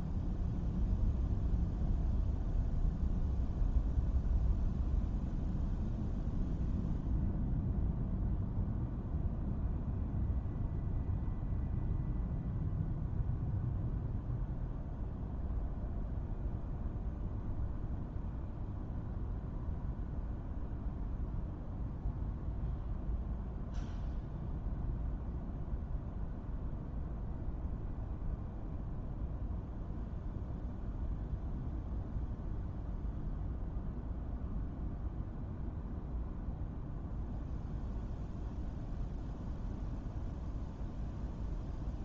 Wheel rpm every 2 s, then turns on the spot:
0, 0, 0, 0, 0, 0, 0, 0, 0, 0, 0, 0, 0, 0, 0, 0, 0, 0, 0, 0, 0.
none